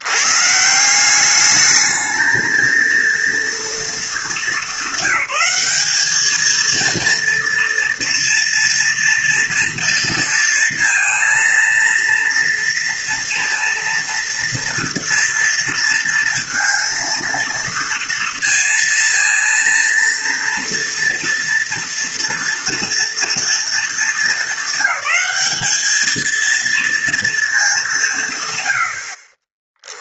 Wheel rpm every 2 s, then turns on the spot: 160, 220, 200, 230, 230, 230, 230, 230, 230, 230, 230, 230, 210, 230, 90.
none